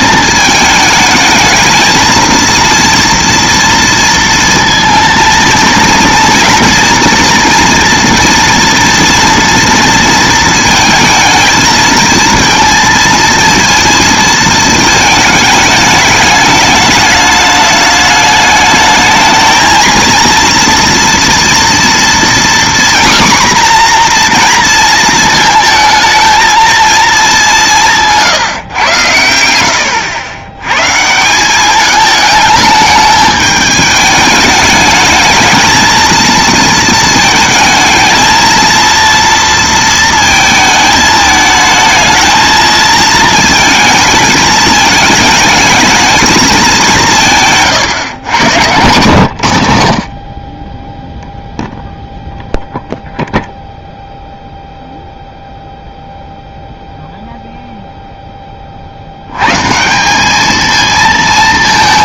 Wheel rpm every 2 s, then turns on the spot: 220, 230, 230, 230, 240, 220, 230, 220, 210, 220, 230, 250, 230, 220, 120, 120, 210, 220, 230, 230, 220, 230, 220, 180, 120, 0, 0, 0, 0, 50, 220.
none